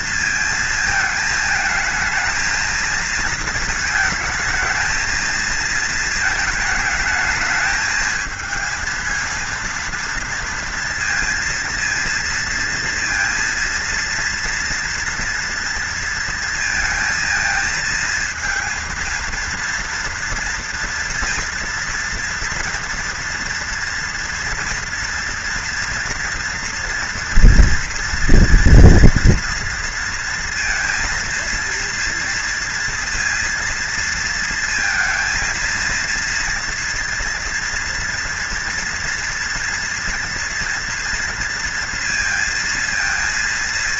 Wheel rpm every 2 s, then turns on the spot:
230, 220, 220, 220, 230, 230, 230, 230, 230, 230, 230, 230, 230, 230, 230, 230, 230, 230, 230, 230, 240, 230.
none